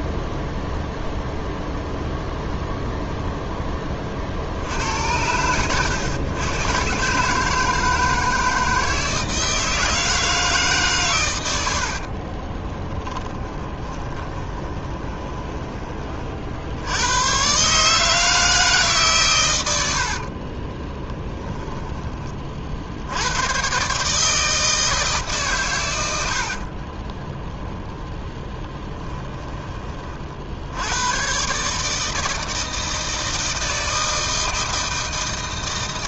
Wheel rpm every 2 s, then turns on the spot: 0, 0, 80, 130, 160, 140, 10, 20, 80, 140, 30, 70, 160, 40, 30, 90, 160, 160.
12-16 20-22 26-30